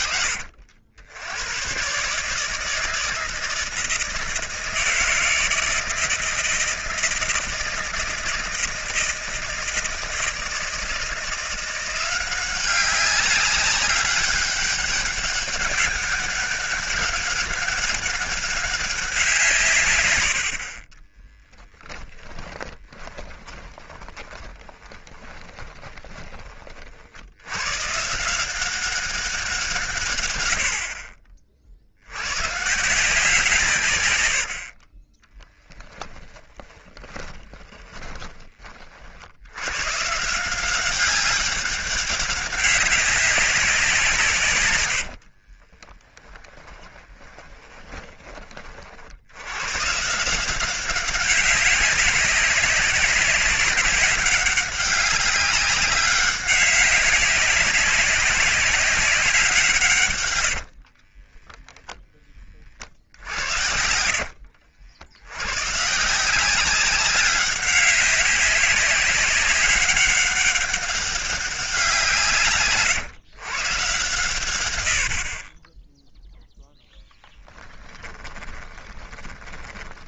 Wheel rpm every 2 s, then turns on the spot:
90, 160, 160, 160, 160, 170, 190, 200, 200, 190, 30, 20, 20, 40, 190, 60, 160, 20, 20, 50, 190, 200, 90, 20, 50, 190, 190, 200, 200, 190, 50, 50, 80, 190, 200, 190, 130, 80, 0, 20.
20-26 36-38 44-48 60-62 78-80